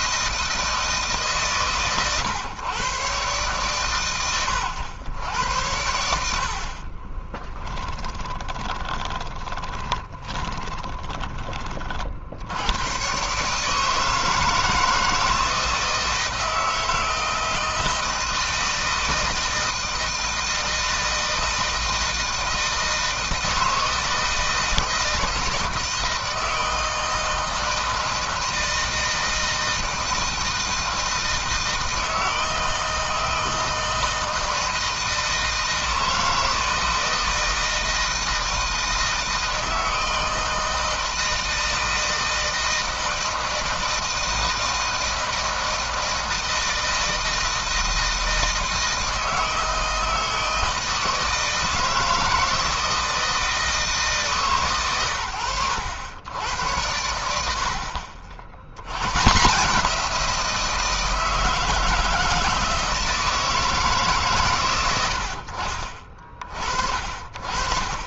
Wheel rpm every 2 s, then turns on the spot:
160, 140, 100, 30, 20, 20, 120, 160, 160, 170, 160, 160, 160, 160, 160, 160, 160, 160, 160, 160, 160, 160, 160, 160, 160, 160, 160, 110, 90, 90, 170, 160, 110, 50.
6-12